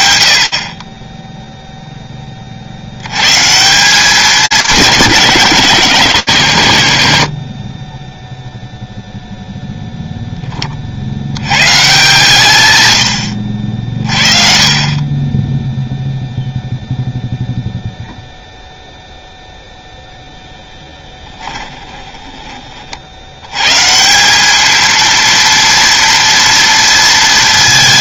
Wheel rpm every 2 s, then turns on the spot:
70, 40, 200, 110, 0, 30, 130, 40, 0, 0, 10, 120, 230, 220.
20-22